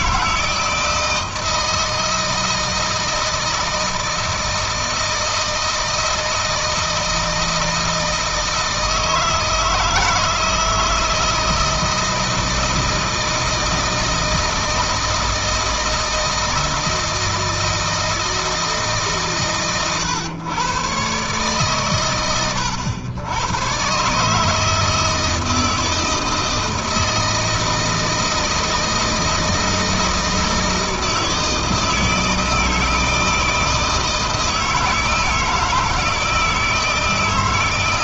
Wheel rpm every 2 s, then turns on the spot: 160, 160, 160, 160, 160, 160, 160, 160, 160, 150, 120, 100, 160, 160, 160, 160, 160, 160, 160.
none